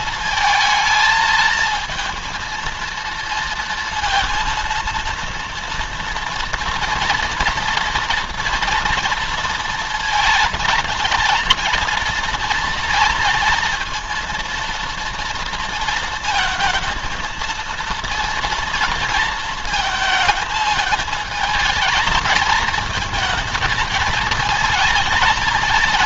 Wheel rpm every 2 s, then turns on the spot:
220, 230, 230, 230, 230, 230, 230, 230, 230, 230, 220, 230, 220.
none